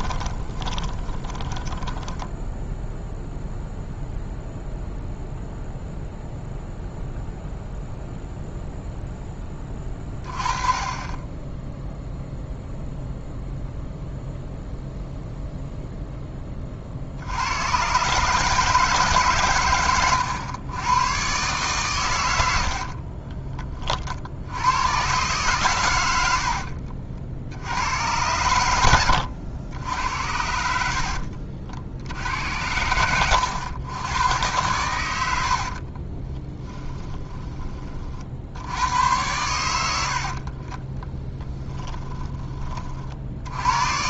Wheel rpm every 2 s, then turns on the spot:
20, 0, 0, 0, 0, 30, 0, 0, 30, 160, 110, 70, 90, 70, 90, 80, 90, 110, 30, 70, 30, 30.
0-2 22-24 26-28 30-32 36-38 40-42